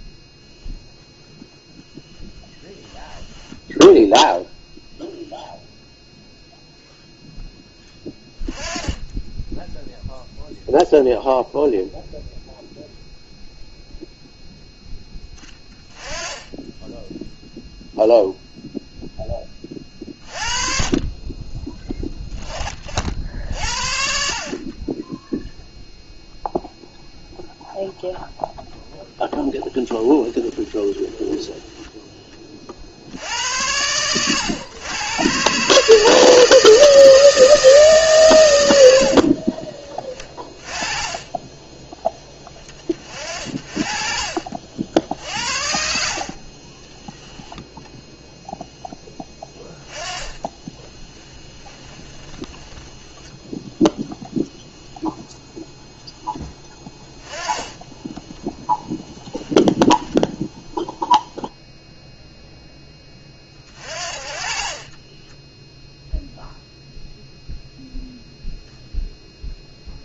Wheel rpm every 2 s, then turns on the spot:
0, 10, 0, 0, 20, 0, 0, 0, 10, 0, 30, 40, 30, 0, 0, 10, 40, 110, 160, 100, 20, 20, 60, 30, 10, 10, 10, 0, 10, 10, 0, 10, 30, 0, 0.
2-4 30-32 46-48 50-54 56-60 64-66